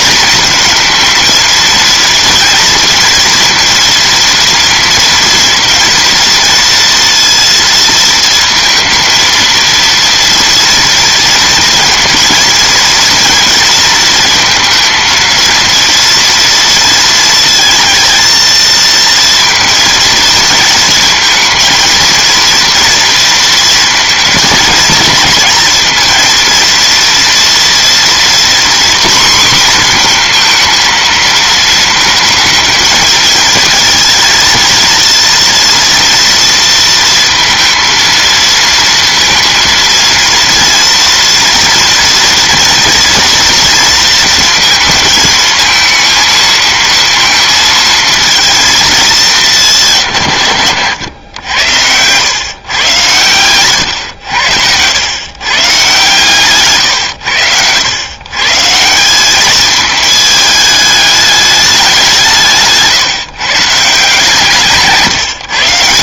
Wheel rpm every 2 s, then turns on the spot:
230, 230, 230, 230, 230, 230, 230, 230, 230, 230, 230, 230, 220, 230, 250, 230, 220, 230, 230, 230, 230, 230, 230, 230, 220, 110, 130, 90, 140, 150, 210, 140, 140.
none